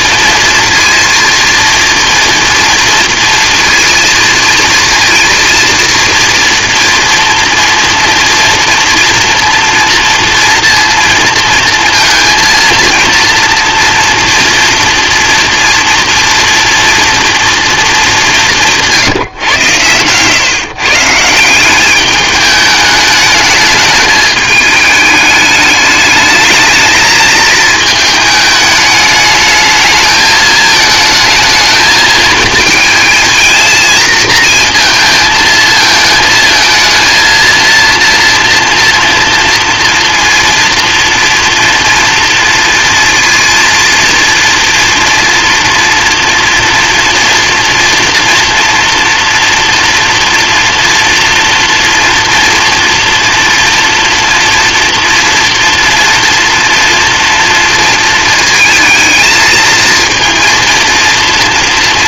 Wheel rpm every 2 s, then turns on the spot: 230, 230, 230, 230, 230, 230, 230, 230, 230, 180, 130, 210, 210, 220, 210, 220, 220, 230, 220, 240, 230, 230, 230, 240, 230, 230, 240, 240, 230, 220, 230.
none